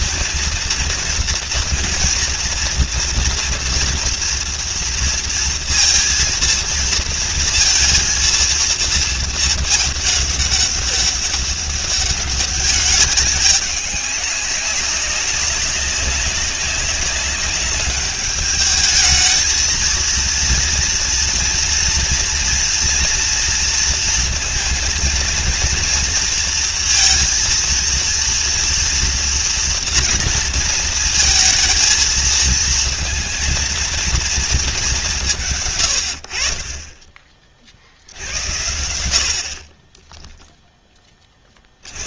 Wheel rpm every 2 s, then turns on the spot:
230, 230, 230, 230, 230, 200, 200, 200, 200, 210, 230, 230, 230, 230, 230, 230, 220, 220, 40, 70, 10.
none